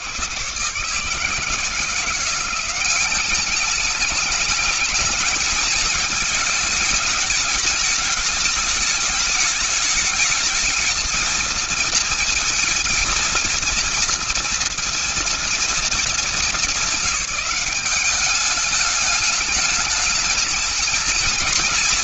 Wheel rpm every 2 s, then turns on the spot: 100, 170, 210, 220, 220, 220, 230, 230, 220, 200, 220.
none